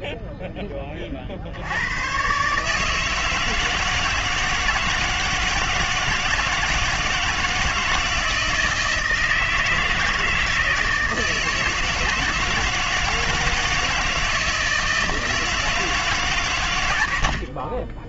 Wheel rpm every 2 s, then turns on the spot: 10, 140, 160, 160, 160, 160, 160, 160, 140.
none